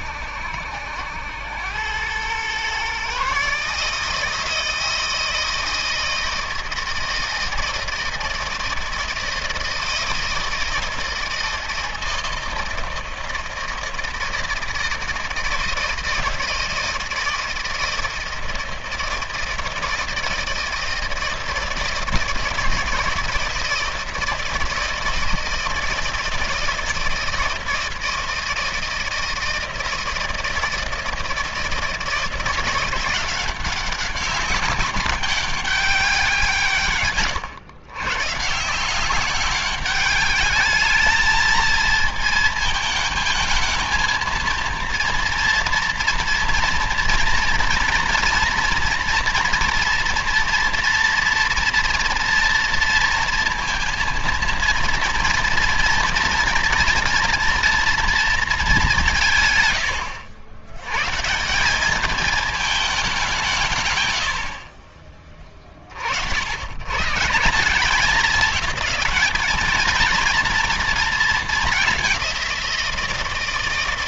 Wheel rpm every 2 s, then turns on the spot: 80, 130, 160, 160, 160, 160, 160, 160, 160, 170, 160, 160, 160, 160, 160, 160, 170, 200, 140, 170, 210, 220, 230, 230, 230, 230, 230, 230, 230, 190, 110, 200, 40, 130, 210, 230, 170.
none